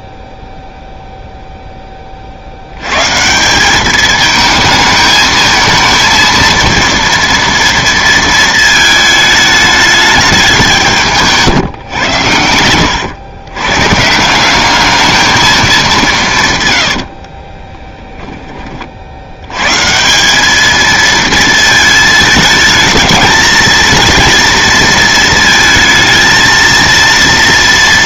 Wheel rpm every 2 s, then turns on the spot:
0, 90, 220, 230, 220, 180, 90, 200, 130, 20, 200, 220, 230, 230.
12-14 16-18